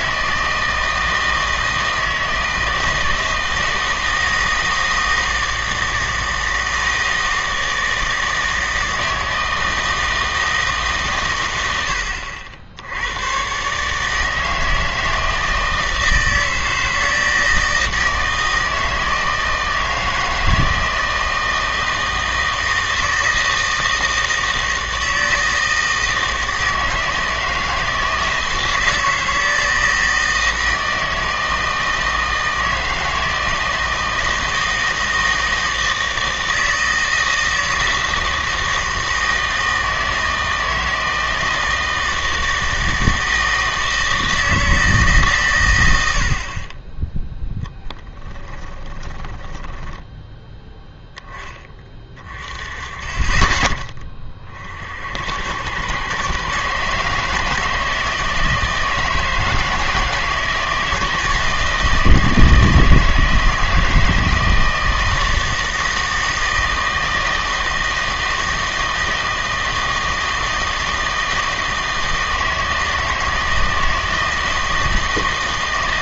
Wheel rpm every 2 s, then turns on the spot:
160, 160, 160, 160, 160, 150, 70, 160, 160, 160, 160, 160, 160, 160, 160, 160, 160, 160, 160, 160, 160, 160, 160, 30, 20, 0, 20, 50, 140, 160, 160, 160, 160, 160, 160, 160, 160, 160.
48-50